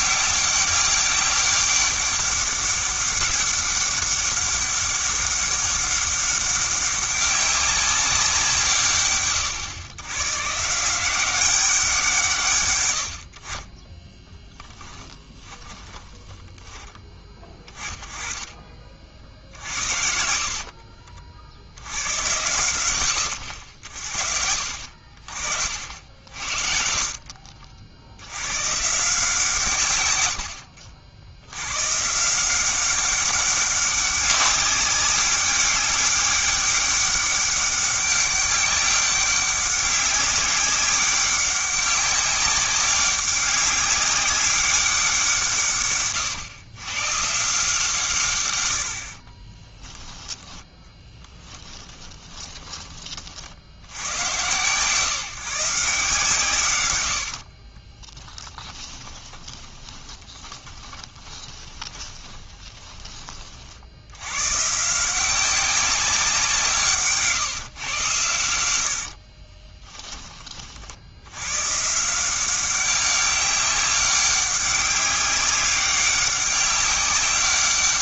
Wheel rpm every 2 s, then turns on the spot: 200, 200, 200, 200, 160, 150, 120, 20, 10, 40, 50, 100, 60, 70, 120, 70, 190, 200, 200, 200, 200, 200, 200, 110, 110, 10, 20, 130, 120, 20, 20, 20, 140, 170, 90, 40, 190, 200, 200.
14-16 20-22 26-28 30-32 58-64